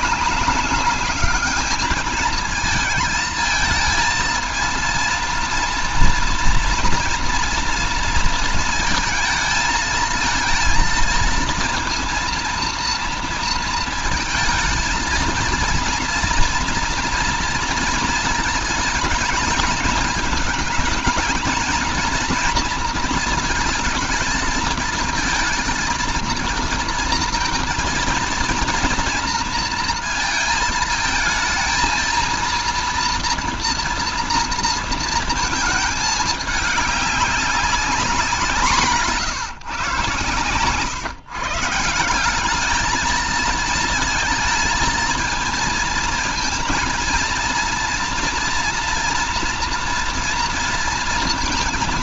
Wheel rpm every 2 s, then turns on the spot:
200, 220, 230, 230, 220, 230, 230, 220, 230, 220, 220, 230, 220, 230, 230, 220, 240, 230, 200, 180, 130, 210, 220, 230, 230, 230.
none